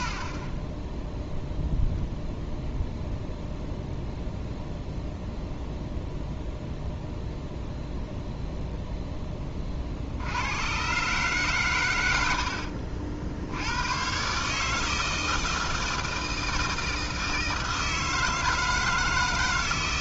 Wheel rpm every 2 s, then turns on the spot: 10, 0, 0, 0, 0, 120, 60, 150, 160, 160.
none